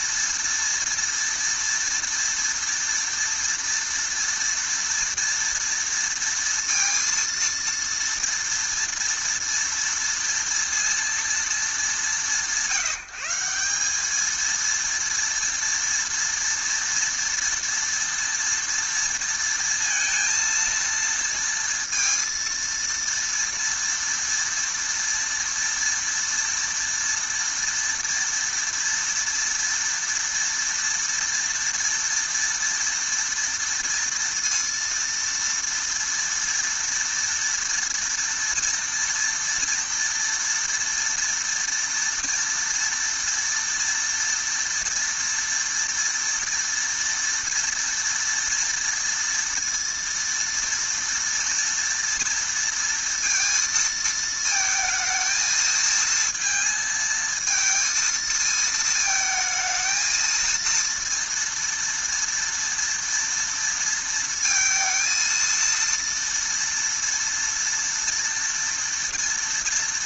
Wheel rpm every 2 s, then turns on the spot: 230, 230, 230, 230, 230, 230, 160, 230, 230, 230, 230, 230, 230, 230, 240, 230, 230, 230, 230, 230, 240, 230, 230, 230, 230, 230, 230, 220, 230, 220, 230, 230, 230, 230, 230.
none